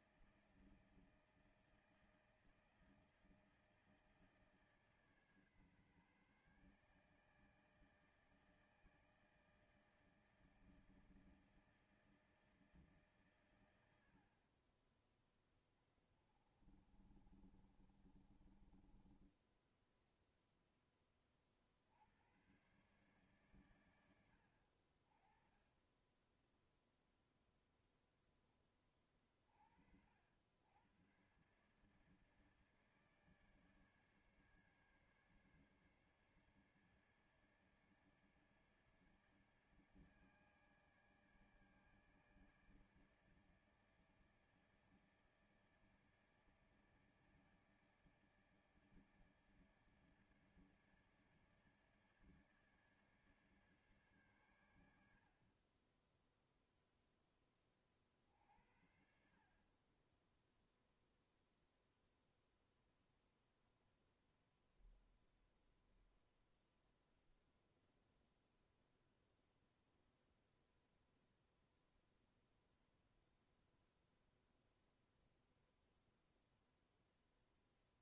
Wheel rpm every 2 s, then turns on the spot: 160, 160, 160, 150, 160, 160, 160, 60, 20, 30, 0, 90, 80, 10, 20, 80, 150, 150, 150, 150, 150, 150, 150, 150, 150, 150, 150, 130, 10, 50, 20, 0, 0, 0, 0, 0, 0, 0, 0.
16-20 26-28